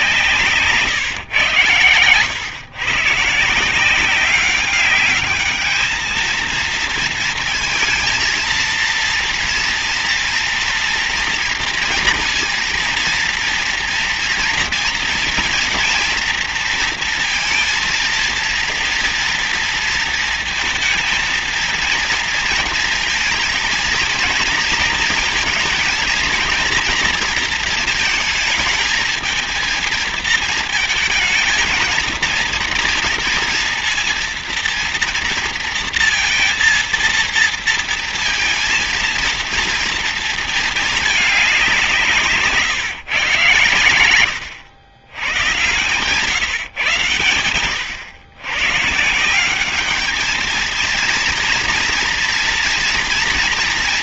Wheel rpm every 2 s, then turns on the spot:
150, 120, 190, 230, 230, 230, 230, 230, 230, 230, 230, 230, 230, 230, 220, 230, 230, 230, 230, 230, 230, 140, 90, 140, 120, 220, 230.
none